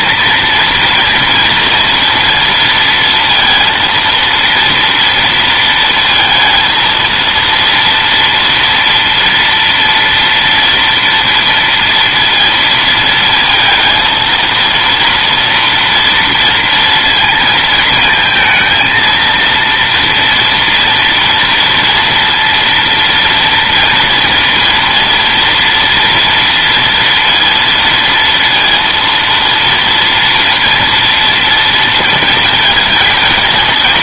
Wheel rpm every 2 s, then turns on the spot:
230, 230, 230, 230, 230, 230, 230, 230, 230, 230, 230, 230, 230, 230, 230, 230, 220.
none